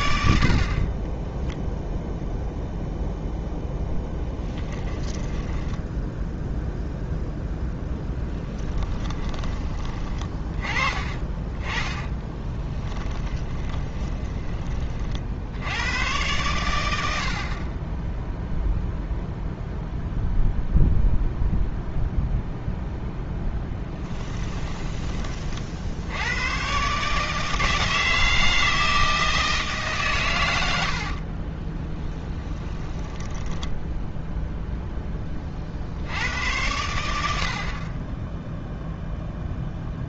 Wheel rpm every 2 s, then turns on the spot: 20, 0, 10, 0, 20, 30, 10, 50, 70, 0, 0, 0, 20, 140, 160, 60, 10, 10, 80, 0.
0-2 4-6 8-10 12-14 30-34